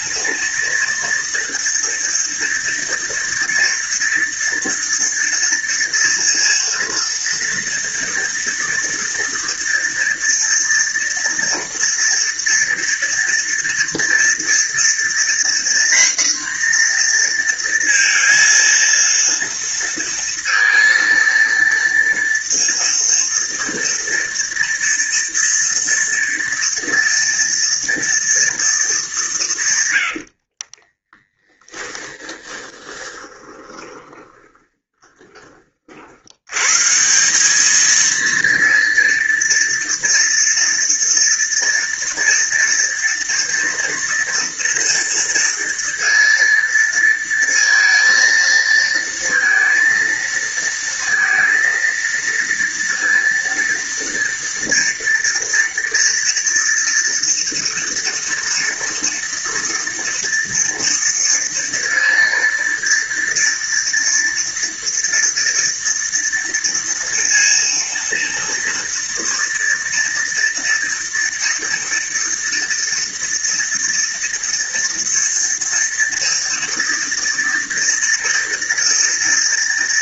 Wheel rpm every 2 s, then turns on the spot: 230, 230, 230, 230, 230, 230, 230, 240, 240, 230, 230, 230, 240, 230, 210, 20, 20, 20, 150, 230, 230, 230, 230, 230, 230, 230, 230, 230, 230, 230, 230, 230, 230, 230, 230, 230, 230, 230, 230, 230.
30-36